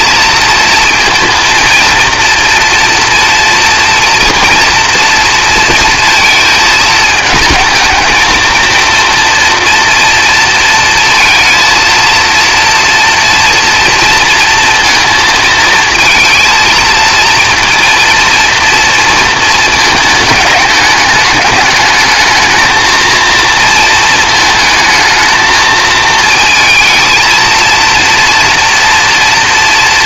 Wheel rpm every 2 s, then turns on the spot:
230, 230, 230, 230, 220, 230, 230, 230, 230, 230, 210, 220, 220, 230, 230.
none